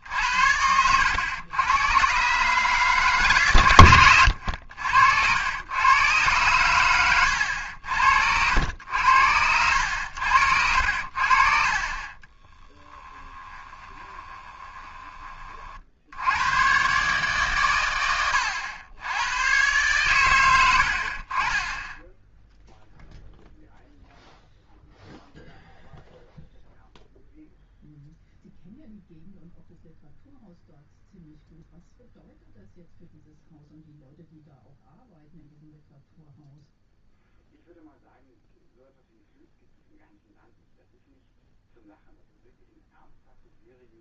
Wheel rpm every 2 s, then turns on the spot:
80, 150, 80, 100, 80, 80, 10, 20, 120, 90, 90, 0, 0, 0, 0, 0, 0, 0, 0, 0, 0, 0.
12-16